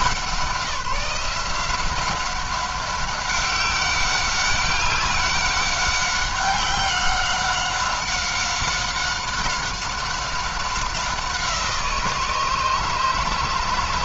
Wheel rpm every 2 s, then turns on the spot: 170, 200, 200, 190, 190, 180, 150.
none